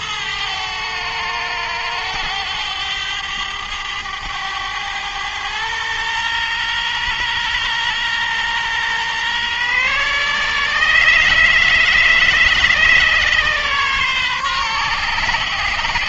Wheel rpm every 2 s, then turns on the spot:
110, 100, 100, 120, 120, 130, 130, 130.
none